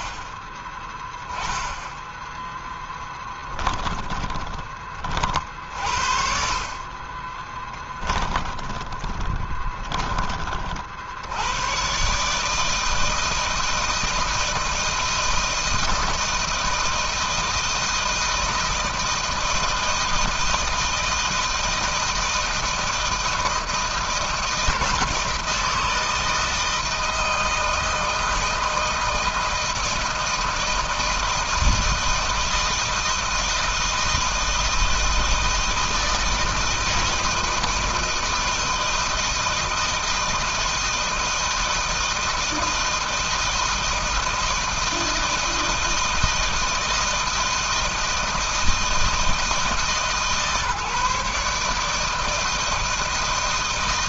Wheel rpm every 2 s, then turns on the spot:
20, 10, 30, 50, 20, 30, 150, 160, 160, 160, 160, 160, 160, 160, 160, 160, 160, 160, 160, 160, 160, 160, 160, 160, 160, 150, 160.
0-4 8-10